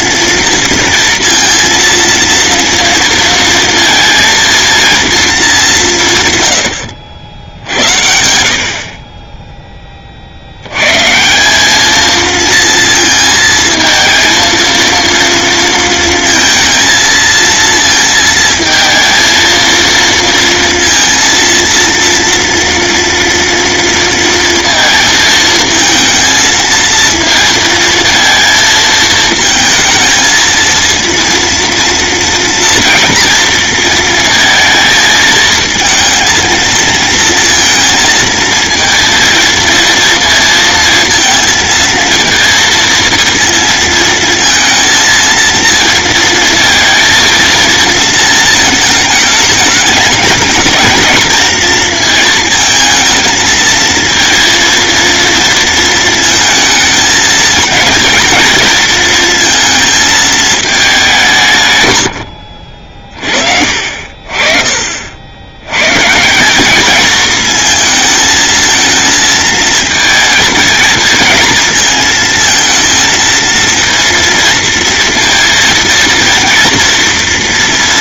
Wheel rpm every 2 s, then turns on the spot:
230, 230, 230, 80, 50, 110, 230, 230, 220, 220, 230, 230, 230, 230, 230, 230, 230, 220, 230, 230, 230, 230, 230, 230, 220, 220, 220, 230, 220, 230, 200, 50, 60, 210, 220, 220, 230, 230, 230.
none